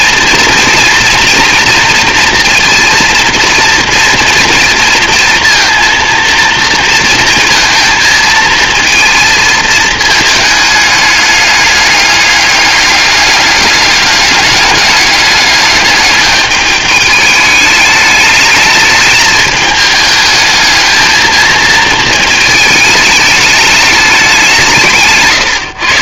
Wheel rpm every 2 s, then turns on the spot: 230, 230, 230, 230, 220, 210, 200, 200, 210, 210, 220, 220, 170.
none